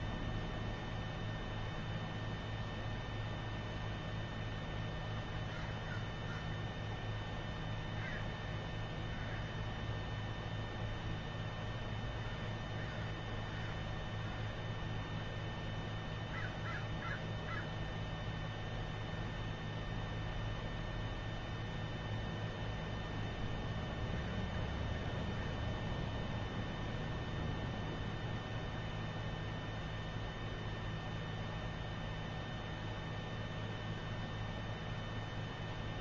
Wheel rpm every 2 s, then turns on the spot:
0, 0, 0, 0, 0, 0, 0, 0, 0, 0, 0, 0, 0, 0, 0, 0, 0, 0.
none